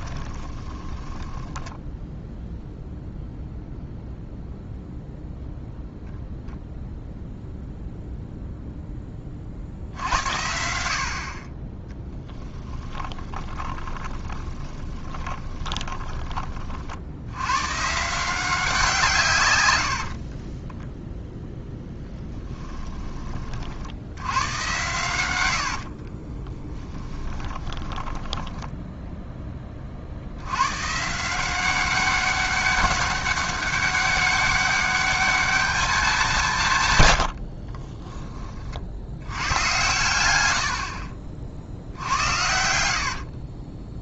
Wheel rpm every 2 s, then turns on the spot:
20, 0, 0, 0, 0, 70, 10, 20, 50, 170, 20, 10, 110, 10, 10, 100, 200, 200, 140, 60, 70, 70.
0-2 12-16 20-24 26-30